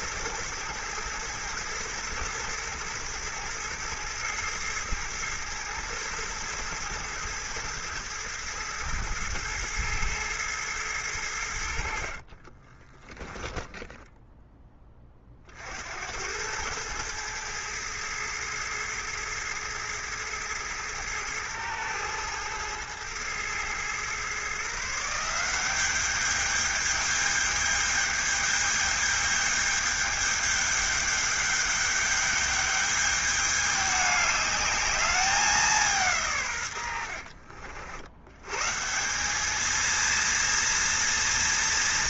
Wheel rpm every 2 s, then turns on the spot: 120, 110, 110, 110, 110, 110, 20, 20, 110, 110, 110, 110, 150, 210, 210, 210, 210, 210, 90, 160, 230.
12-14